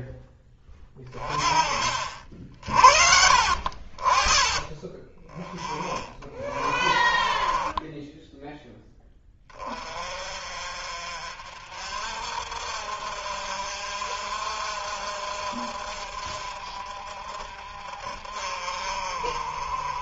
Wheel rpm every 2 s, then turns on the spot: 10, 60, 20, 30, 10, 40, 50, 50, 50, 50.
6-8